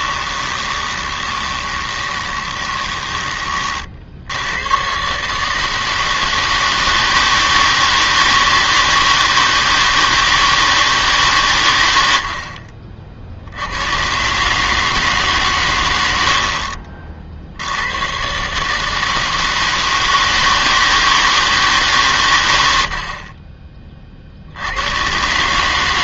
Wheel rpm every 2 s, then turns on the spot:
20, 20, 100, 160, 160, 160, 50, 140, 50, 140, 160, 90, 80.
0-4